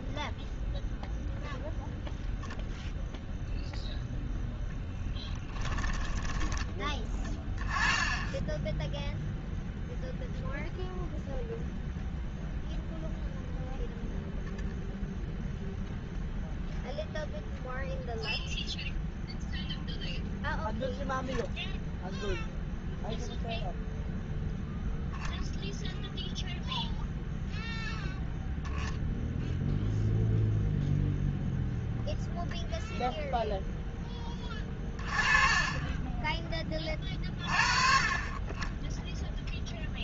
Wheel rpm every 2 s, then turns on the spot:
0, 0, 0, 20, 10, 0, 0, 0, 0, 0, 0, 0, 0, 0, 0, 0, 0, 20, 40, 10.
none